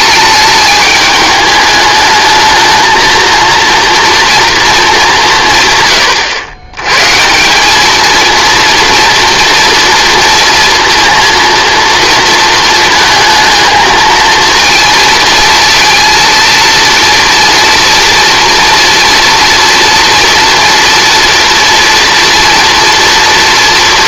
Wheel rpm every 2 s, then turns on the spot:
210, 220, 220, 110, 230, 230, 220, 230, 230, 240, 230, 230.
none